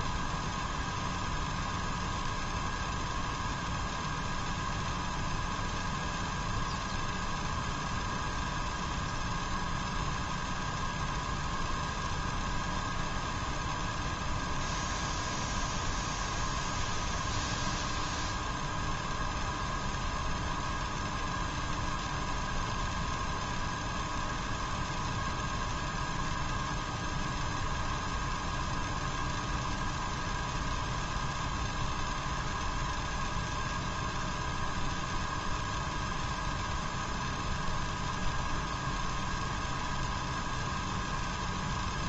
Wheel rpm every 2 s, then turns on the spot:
0, 0, 0, 0, 0, 0, 0, 0, 0, 0, 0, 0, 0, 0, 0, 0, 0, 0, 0, 0, 0.
none